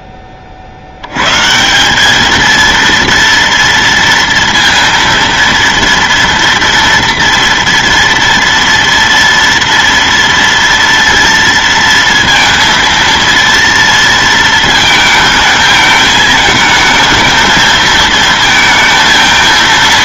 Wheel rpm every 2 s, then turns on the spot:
50, 230, 230, 230, 230, 230, 230, 230, 220, 230.
none